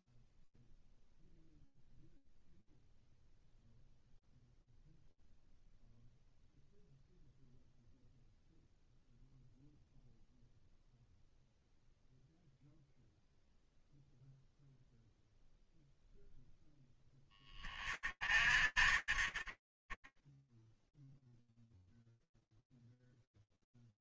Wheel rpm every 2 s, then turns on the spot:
0, 0, 0, 0, 0, 0, 0, 0, 40, 10, 0, 0.
none